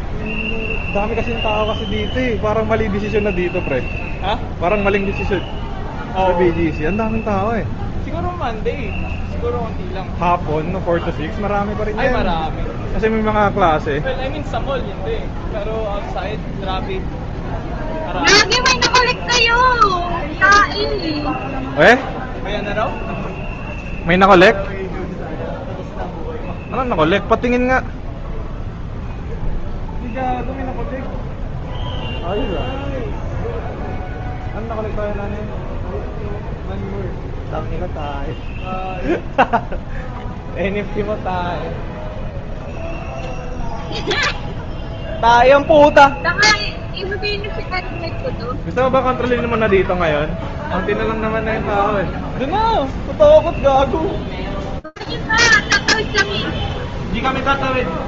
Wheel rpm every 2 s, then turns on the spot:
0, 0, 0, 0, 0, 0, 0, 0, 0, 0, 0, 0, 0, 0, 0, 0, 0, 0, 0, 0, 0, 0, 0, 0, 0, 0, 0, 0, 0.
none